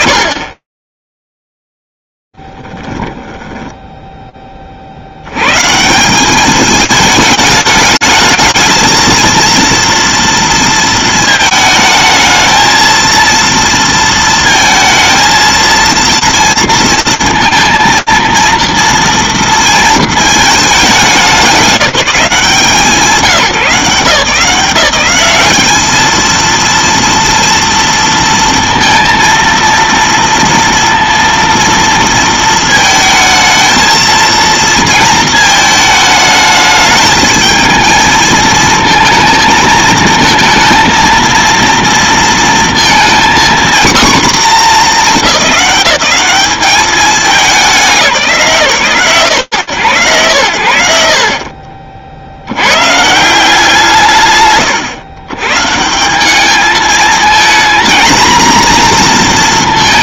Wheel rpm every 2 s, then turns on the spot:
0, 0, 10, 100, 220, 230, 220, 230, 230, 230, 230, 200, 170, 210, 230, 230, 230, 230, 220, 220, 220, 230, 240, 190, 180, 90, 50, 150, 180, 230.
4-6